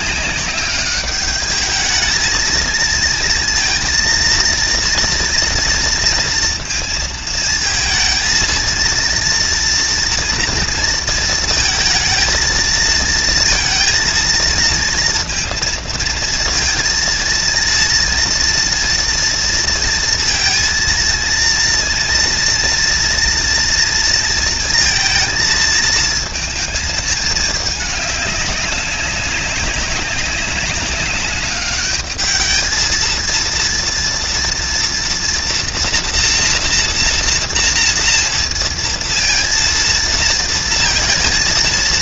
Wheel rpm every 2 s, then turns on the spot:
200, 230, 230, 230, 230, 230, 230, 230, 230, 230, 230, 230, 230, 220, 200, 200, 230, 230, 230, 230, 230.
none